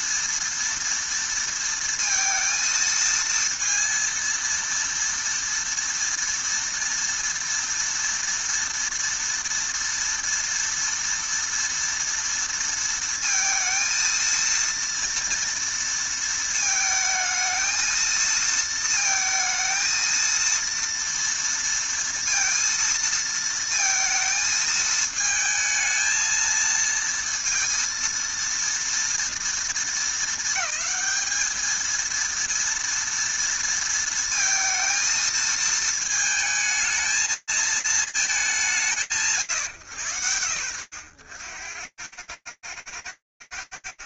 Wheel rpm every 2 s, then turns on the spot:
230, 230, 230, 230, 230, 230, 230, 230, 220, 220, 230, 230, 220, 230, 230, 220, 230, 230, 220, 180, 80, 70.
none